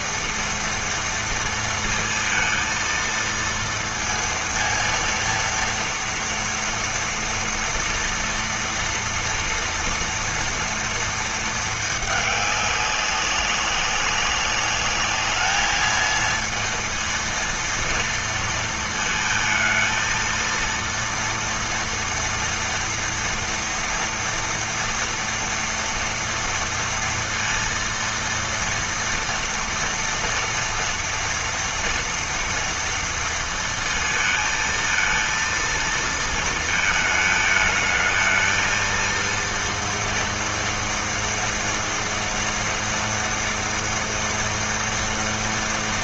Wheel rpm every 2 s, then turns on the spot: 230, 230, 230, 230, 230, 230, 200, 210, 230, 220, 230, 230, 230, 230, 230, 230, 230, 230, 220, 230, 230, 230, 230.
none